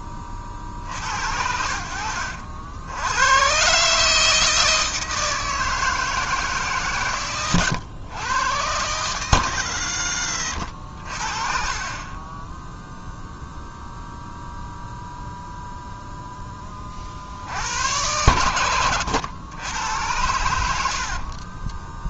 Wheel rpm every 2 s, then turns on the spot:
50, 80, 160, 150, 120, 60, 0, 0, 20, 100, 80.
10-12 18-20